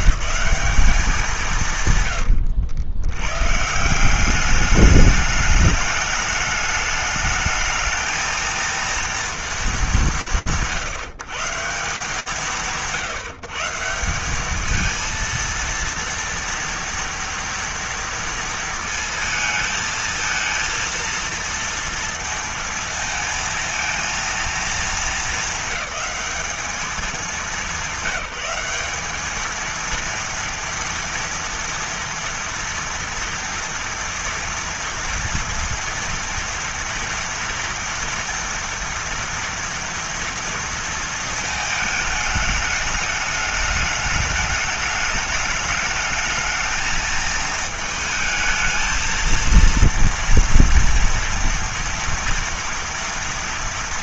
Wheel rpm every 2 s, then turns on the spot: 160, 100, 190, 210, 230, 150, 140, 200, 230, 230, 230, 230, 220, 200, 200, 230, 230, 230, 230, 230, 230, 210, 210, 220, 220, 230, 230.
none